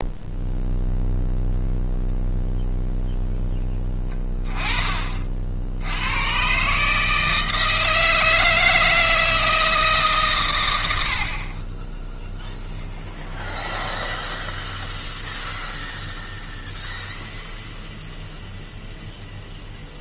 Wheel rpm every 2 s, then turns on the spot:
0, 0, 30, 140, 160, 100, 0, 0, 0, 0.
none